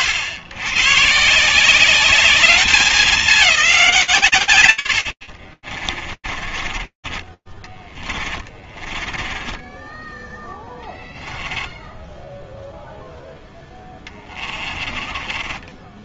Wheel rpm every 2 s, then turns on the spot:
130, 200, 100, 30, 10, 10, 10, 20.
6-16